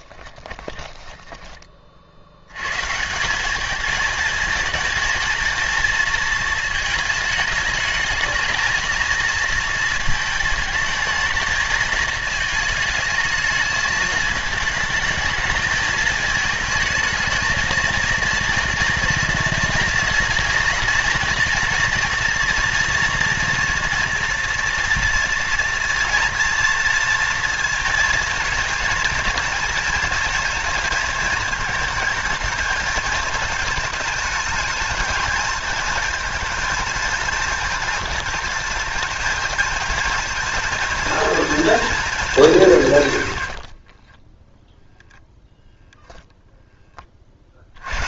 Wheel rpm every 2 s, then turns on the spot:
10, 140, 220, 220, 220, 230, 220, 220, 220, 230, 230, 230, 230, 230, 220, 230, 220, 220, 230, 230, 230, 160, 0, 20.
0-2